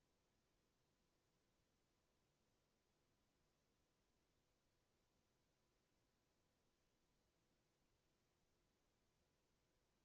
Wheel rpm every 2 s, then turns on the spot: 0, 0, 0, 0, 0.
none